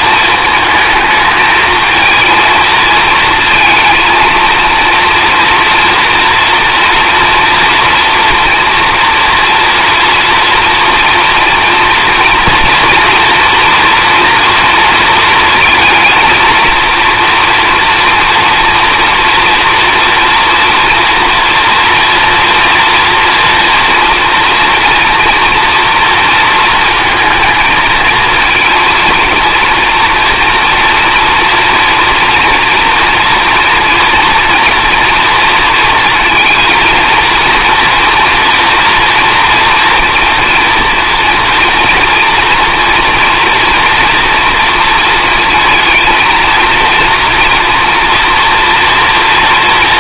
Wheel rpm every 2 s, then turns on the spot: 220, 220, 230, 230, 240, 230, 240, 230, 230, 230, 230, 230, 230, 230, 230, 230, 230, 230, 230, 240, 230, 240, 230, 230, 230.
none